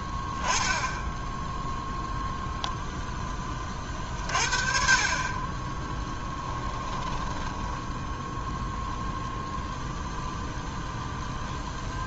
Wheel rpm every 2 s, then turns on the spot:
10, 0, 50, 10, 0, 0.
6-8